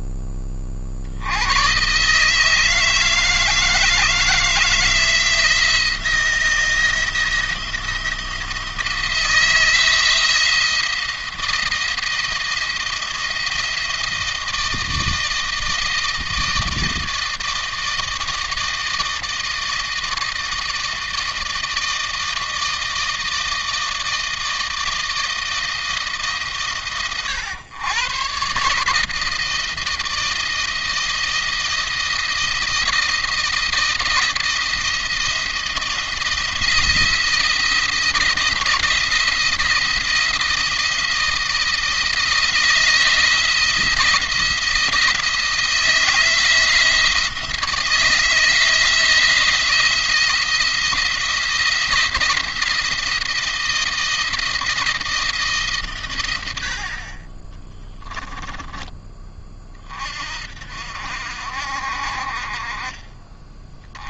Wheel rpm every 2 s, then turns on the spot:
30, 160, 160, 170, 170, 170, 170, 160, 160, 160, 160, 160, 160, 140, 140, 160, 160, 160, 170, 160, 170, 160, 170, 170, 170, 170, 170, 160, 80, 20, 60, 30.
none